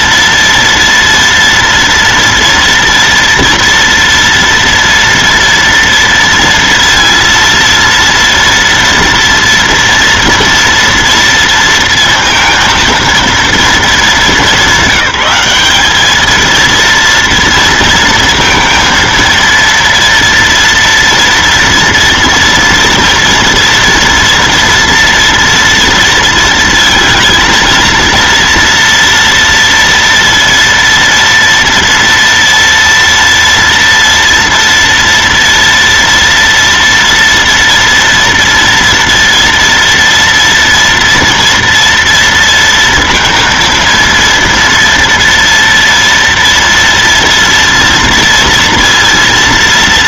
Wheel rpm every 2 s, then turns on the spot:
230, 230, 230, 230, 230, 230, 230, 210, 230, 230, 230, 230, 230, 230, 230, 230, 230, 230, 230, 230, 230, 230, 230, 230, 230.
none